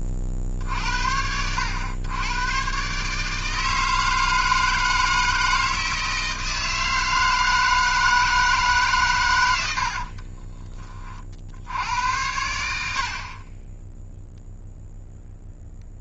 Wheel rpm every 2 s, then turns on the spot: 60, 130, 160, 160, 140, 40, 70, 0.
none